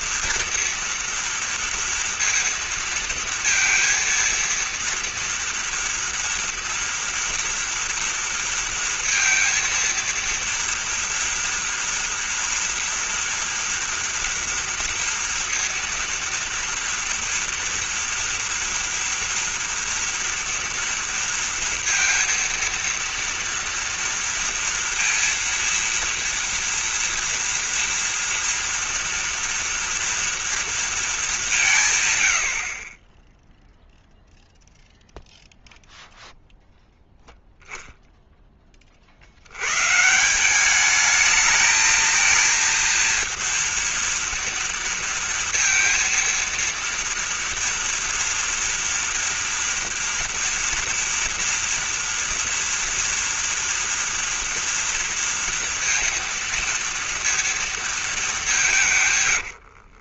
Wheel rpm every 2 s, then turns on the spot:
230, 230, 230, 230, 230, 230, 230, 230, 230, 230, 230, 230, 230, 230, 230, 230, 90, 0, 0, 10, 180, 230, 230, 230, 230, 230, 230, 230, 230, 190.
32-34